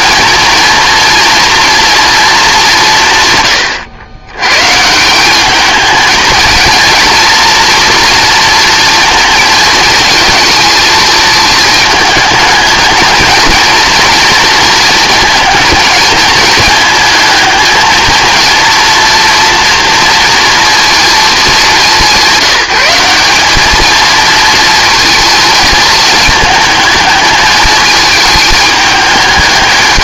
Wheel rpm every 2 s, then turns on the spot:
230, 190, 130, 220, 230, 220, 220, 220, 220, 230, 230, 190, 220, 220, 210.
none